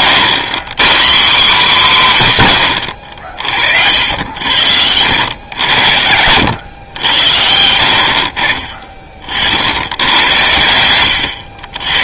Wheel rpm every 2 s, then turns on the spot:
130, 100, 80, 100, 30, 110.
none